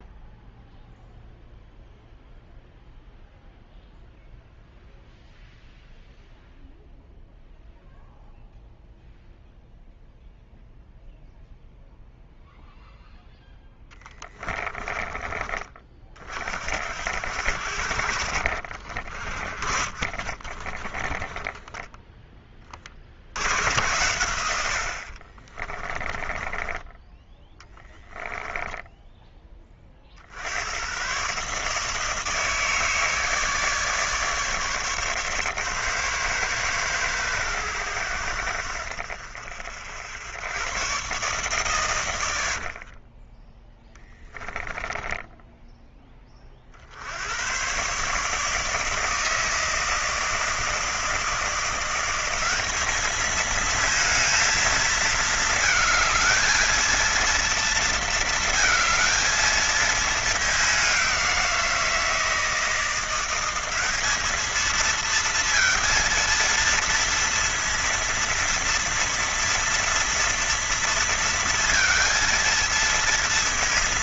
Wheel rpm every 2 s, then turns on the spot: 0, 0, 0, 0, 0, 0, 0, 30, 60, 50, 20, 40, 70, 10, 0, 110, 160, 150, 130, 70, 110, 50, 10, 60, 160, 160, 200, 220, 230, 220, 200, 170, 230, 230, 230, 230, 230.
14-16 18-22 26-28 42-44